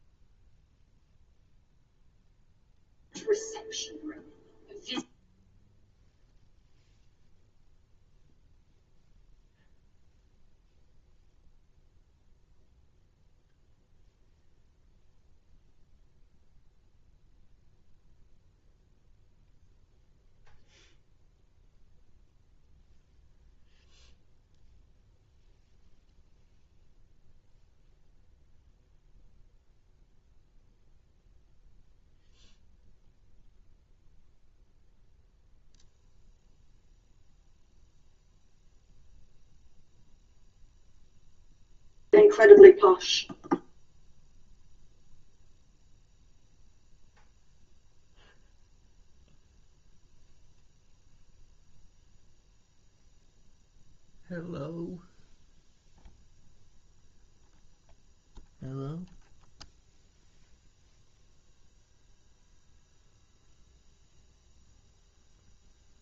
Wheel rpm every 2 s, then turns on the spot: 0, 0, 0, 0, 0, 0, 0, 0, 0, 0, 0, 0, 0, 0, 0, 0, 0, 0, 0, 0, 0, 0, 0, 0, 0, 0, 0, 0, 0, 0, 0, 0, 0.
none